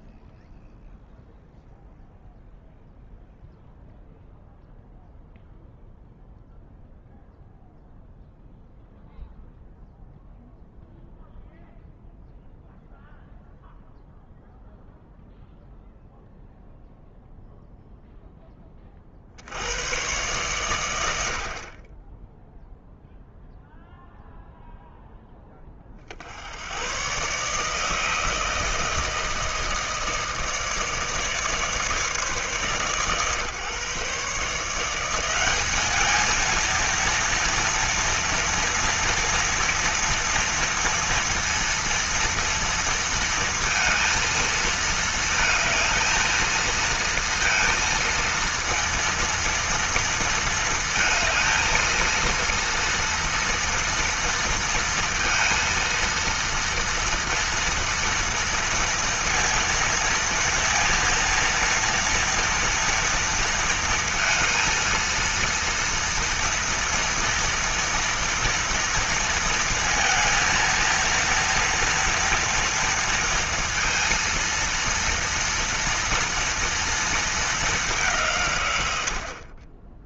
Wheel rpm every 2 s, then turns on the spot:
0, 0, 0, 0, 0, 0, 0, 0, 0, 30, 120, 0, 0, 120, 160, 150, 130, 170, 230, 230, 230, 230, 230, 230, 230, 220, 230, 230, 230, 230, 230, 230, 230, 230, 230, 230, 230, 230, 230, 90.
none